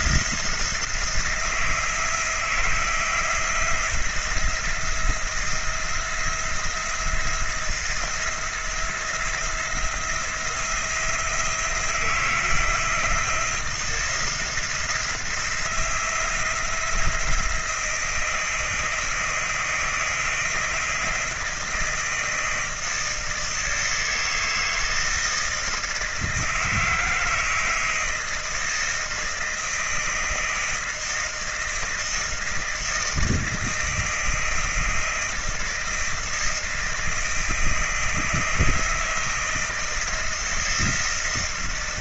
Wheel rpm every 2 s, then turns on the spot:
170, 170, 170, 170, 170, 170, 170, 170, 170, 160, 160, 160, 160, 160, 160, 160, 160, 160, 160, 160, 160.
none